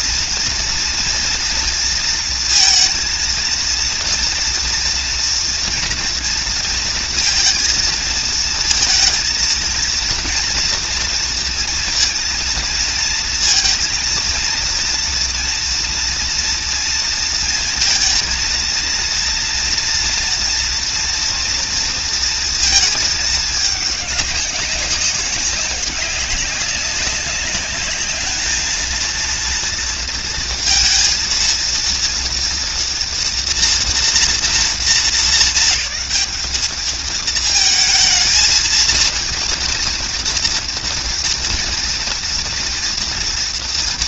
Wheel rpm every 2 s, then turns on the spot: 230, 230, 230, 230, 230, 230, 230, 230, 230, 230, 230, 220, 190, 190, 230, 230, 240, 210, 210, 230, 230, 230.
none